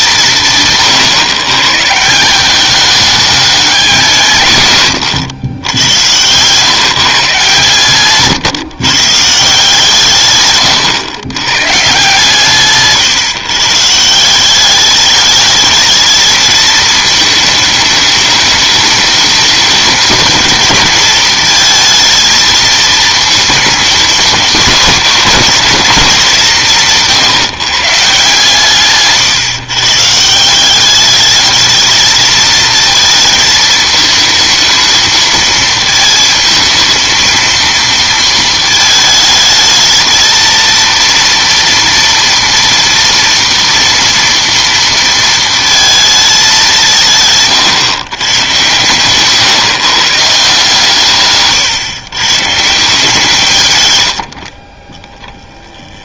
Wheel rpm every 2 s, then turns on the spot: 140, 200, 120, 150, 150, 120, 140, 200, 220, 210, 220, 230, 230, 170, 140, 190, 220, 220, 220, 220, 230, 230, 230, 180, 120, 150, 170, 20.
12-14 54-56